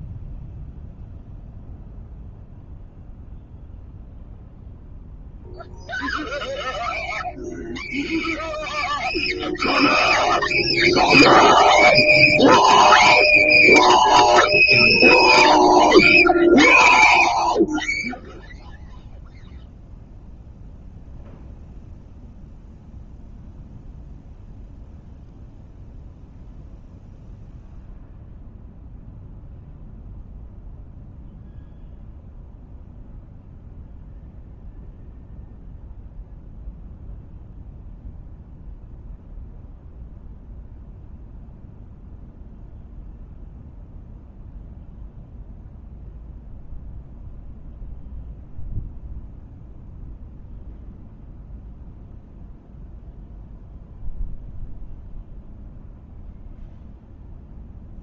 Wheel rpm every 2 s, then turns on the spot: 0, 0, 0, 0, 0, 0, 0, 0, 0, 0, 0, 0, 0, 0, 0, 0, 0, 0, 0, 0, 0, 0, 0, 0, 0, 0, 0, 0, 0.
none